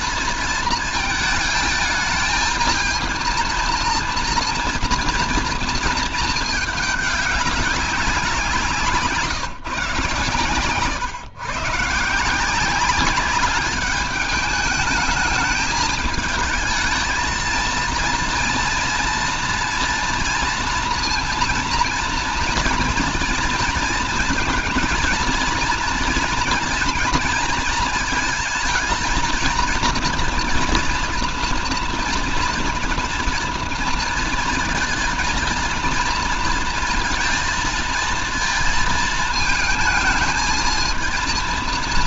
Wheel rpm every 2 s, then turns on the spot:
220, 230, 240, 210, 160, 130, 190, 220, 220, 230, 230, 230, 230, 230, 220, 230, 230, 230, 230, 230, 220.
8-10